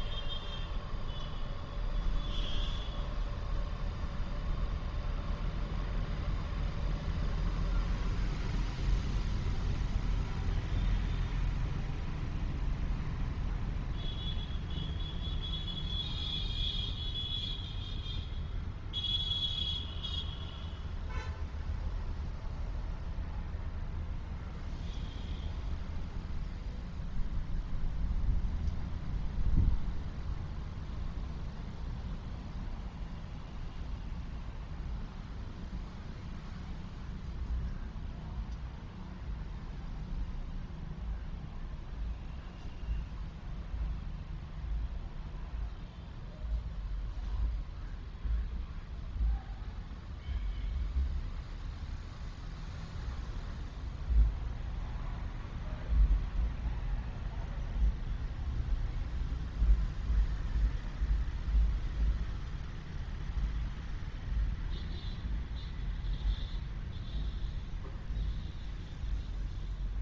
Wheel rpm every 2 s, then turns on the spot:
0, 0, 0, 0, 0, 0, 0, 0, 0, 0, 0, 0, 0, 0, 0, 0, 0, 0, 0, 0, 0, 0, 0, 0, 0, 0, 0, 0, 0, 0, 0, 0, 0, 0, 0.
none